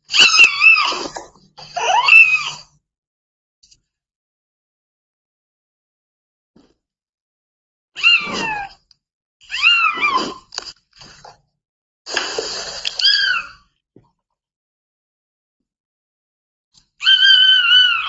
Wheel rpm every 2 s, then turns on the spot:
0, 0, 0, 0, 0, 0, 0, 0, 0.
none